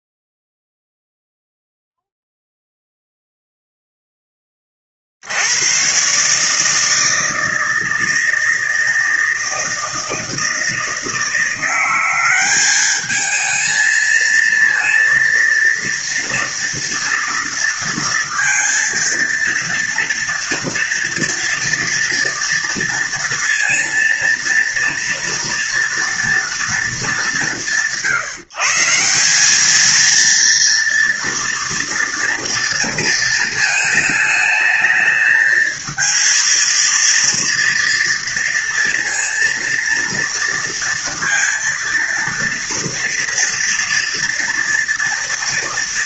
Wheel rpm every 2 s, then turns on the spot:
0, 0, 30, 160, 160, 160, 210, 230, 230, 230, 230, 230, 230, 200, 160, 230, 230, 220, 230, 230, 230, 230, 230.
none